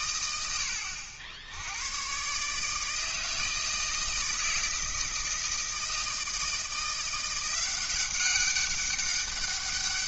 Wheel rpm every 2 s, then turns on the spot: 90, 150, 160, 170, 200.
none